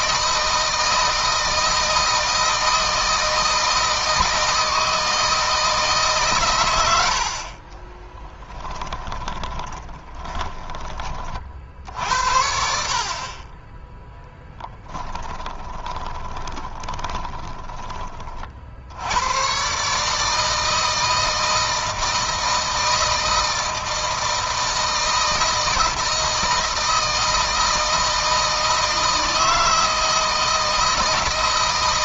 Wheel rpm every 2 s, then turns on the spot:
160, 160, 160, 100, 10, 20, 60, 10, 20, 50, 160, 160, 160, 160, 160, 160.
8-10 14-18